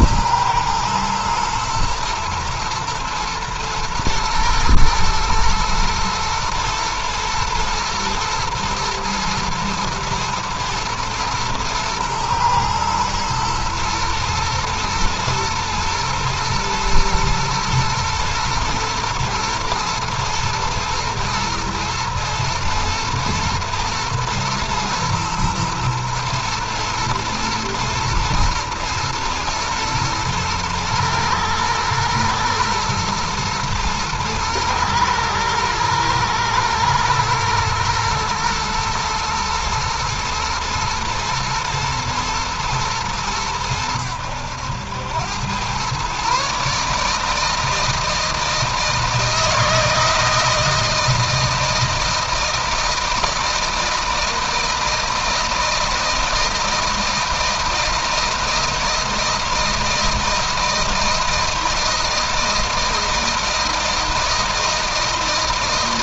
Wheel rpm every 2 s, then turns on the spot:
110, 120, 120, 110, 120, 120, 110, 110, 110, 110, 110, 110, 110, 110, 120, 110, 110, 110, 110, 110, 120, 110, 90, 150, 160, 160, 160, 160, 160, 160, 160, 160, 160.
none